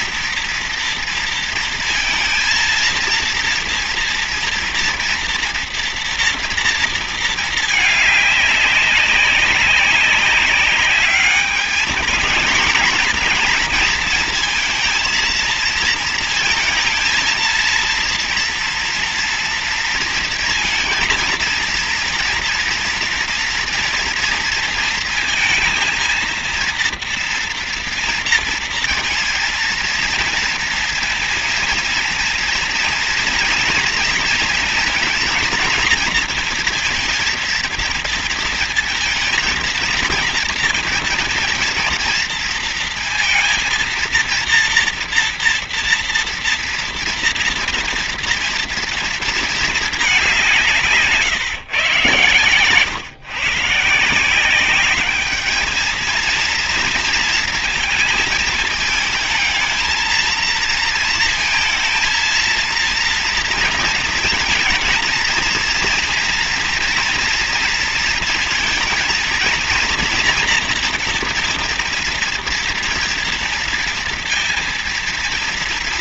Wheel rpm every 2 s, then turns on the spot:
240, 230, 230, 230, 200, 200, 220, 230, 230, 230, 230, 230, 230, 230, 230, 230, 230, 230, 230, 230, 230, 230, 230, 230, 230, 180, 130, 190, 230, 220, 220, 230, 230, 240, 230, 230, 230, 230.
none